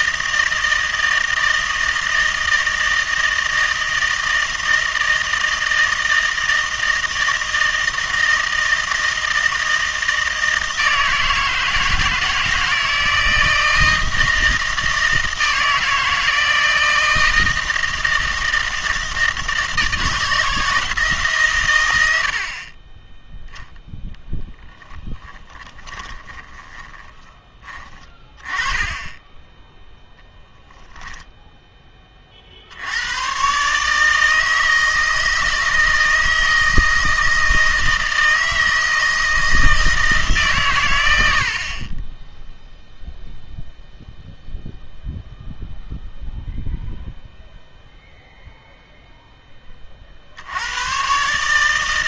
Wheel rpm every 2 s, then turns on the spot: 160, 160, 160, 160, 160, 160, 160, 160, 160, 160, 160, 30, 10, 20, 20, 0, 60, 160, 160, 160, 130, 0, 0, 0, 0, 90.
22-28